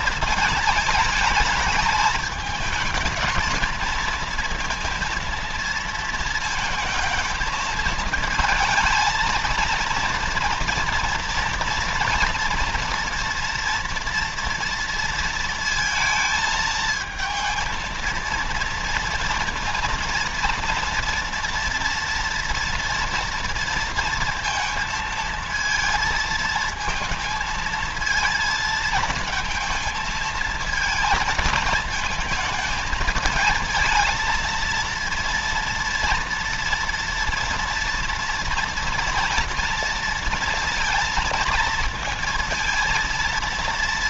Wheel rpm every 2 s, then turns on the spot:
220, 220, 230, 230, 220, 230, 240, 230, 220, 230, 240, 230, 230, 230, 220, 220, 220, 230, 230, 230, 230, 230.
none